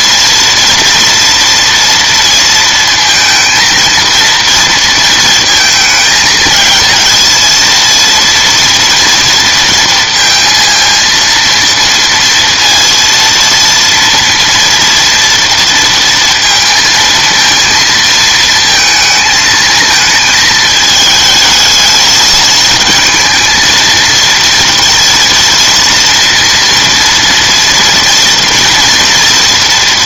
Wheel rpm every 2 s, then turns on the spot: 230, 230, 230, 220, 230, 230, 230, 230, 230, 220, 220, 220, 230, 230, 230.
none